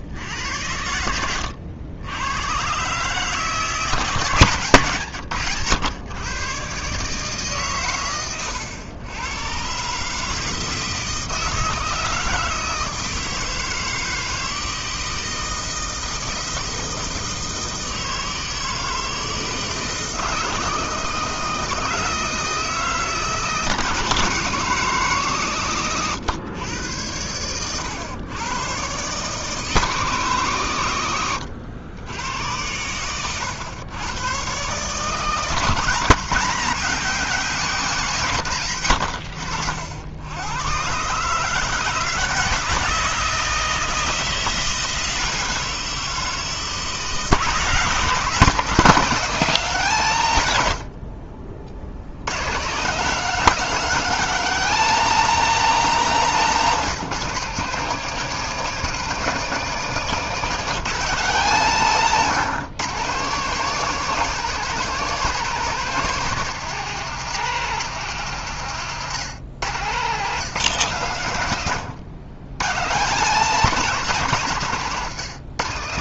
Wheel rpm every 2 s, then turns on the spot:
90, 120, 140, 130, 110, 160, 160, 160, 160, 160, 160, 160, 150, 110, 120, 120, 100, 130, 180, 120, 120, 160, 170, 160, 180, 80, 150, 220, 190, 220, 200, 150, 210, 190, 150, 160, 120, 160.
56-58